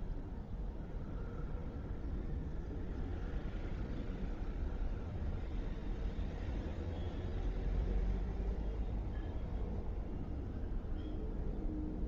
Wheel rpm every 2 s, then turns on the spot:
0, 0, 0, 0, 0, 0.
none